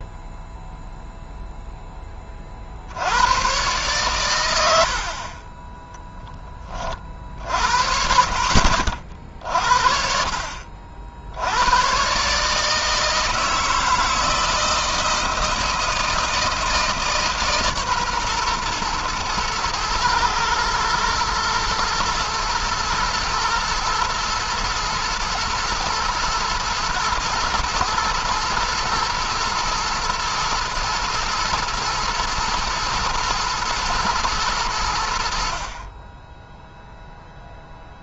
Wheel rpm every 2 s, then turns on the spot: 0, 20, 100, 20, 60, 50, 140, 160, 160, 130, 110, 110, 110, 110, 120, 120, 120, 110, 10.
none